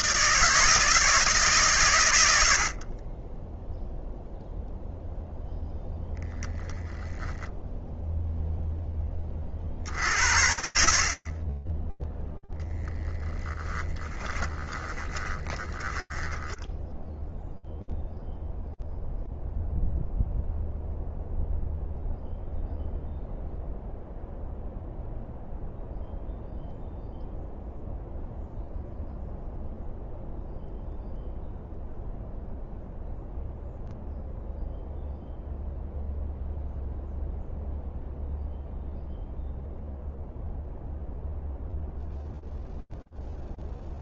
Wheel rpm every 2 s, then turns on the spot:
160, 20, 0, 20, 30, 30, 20, 10, 0, 0, 0, 0, 0, 0, 0, 0, 0, 0, 0, 0, 0, 0.
6-8 12-16